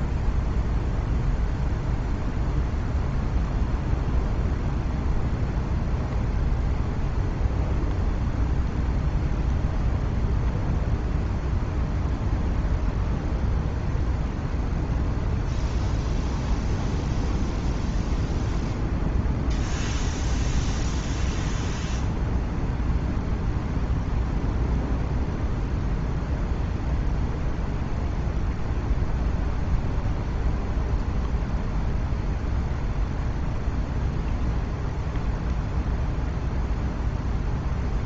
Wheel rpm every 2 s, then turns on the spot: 0, 0, 0, 0, 0, 0, 0, 0, 0, 0, 0, 0, 0, 0, 0, 0, 0, 0, 0.
none